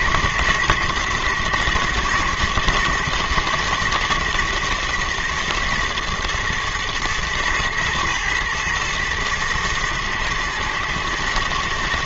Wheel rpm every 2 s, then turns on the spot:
110, 110, 120, 110, 110, 110.
none